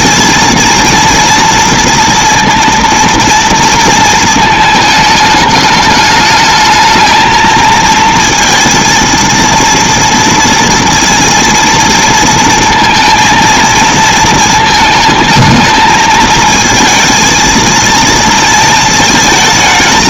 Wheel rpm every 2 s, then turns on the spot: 230, 230, 220, 210, 230, 230, 230, 220, 220, 230.
none